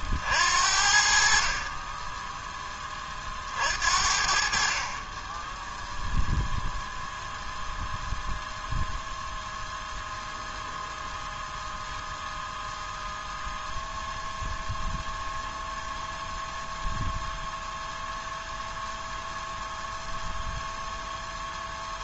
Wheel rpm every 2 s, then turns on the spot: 60, 20, 30, 0, 0, 0, 0, 0, 0, 0, 0.
none